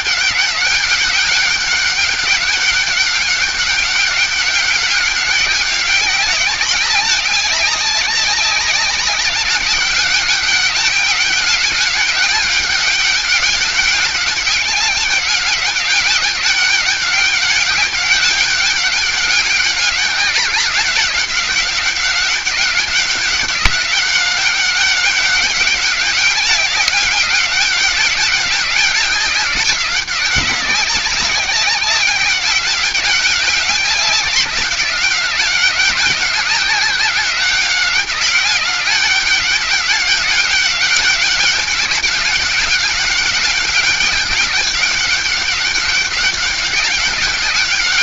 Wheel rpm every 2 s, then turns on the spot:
190, 190, 200, 190, 200, 200, 200, 200, 200, 200, 200, 190, 190, 190, 190, 190, 190, 190, 190, 190, 200, 200, 200, 190.
none